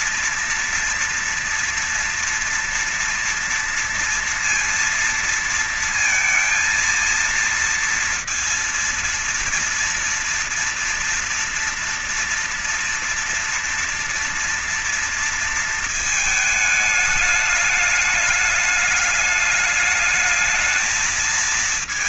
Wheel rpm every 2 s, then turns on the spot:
240, 230, 230, 230, 230, 230, 240, 230, 220, 210, 220.
none